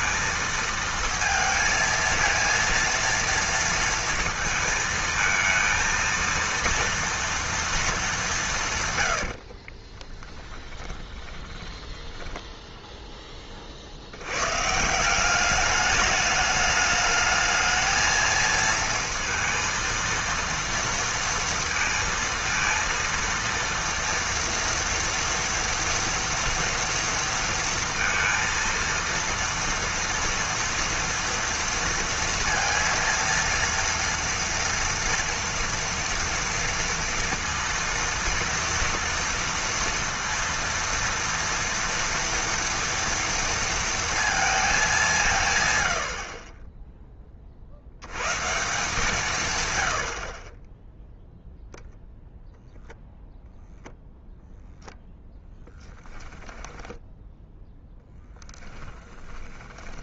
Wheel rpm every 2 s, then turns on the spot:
230, 230, 220, 230, 130, 10, 0, 170, 210, 230, 230, 230, 240, 230, 230, 230, 230, 230, 230, 230, 230, 230, 210, 10, 150, 10, 0, 0, 10, 20.
10-12 56-60